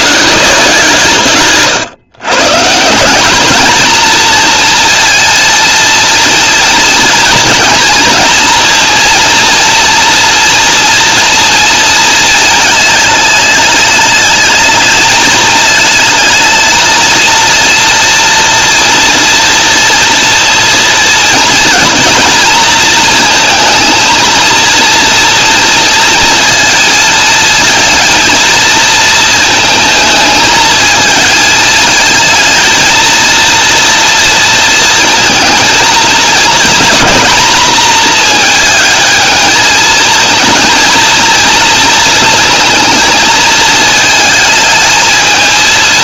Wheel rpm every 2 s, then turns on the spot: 160, 160, 230, 230, 230, 230, 220, 220, 220, 230, 230, 230, 230, 230, 230, 220, 220, 230, 240, 220, 230, 230, 220.
none